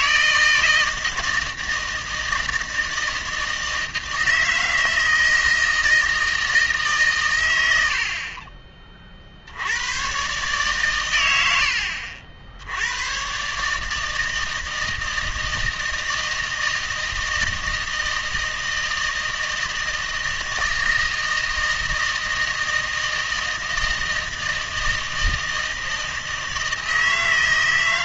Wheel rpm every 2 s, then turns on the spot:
160, 160, 160, 160, 30, 130, 80, 160, 160, 160, 160, 160, 160, 160.
none